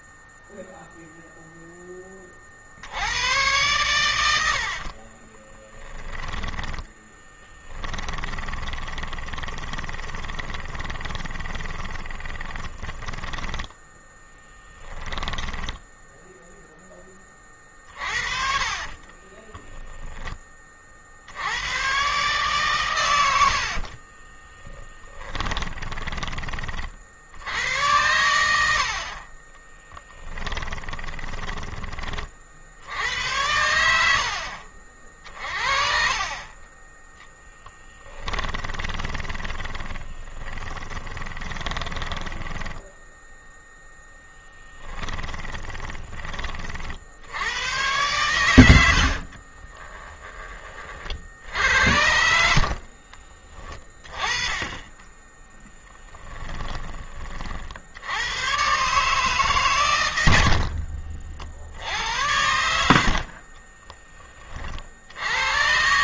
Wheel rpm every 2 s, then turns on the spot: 0, 90, 40, 10, 20, 20, 10, 10, 20, 40, 70, 110, 10, 50, 50, 20, 90, 50, 20, 20, 20, 10, 10, 60, 70, 50, 40, 20, 30, 140, 50, 50, 60.
4-16 18-20 24-26 30-32 34-36 38-46 48-50 52-56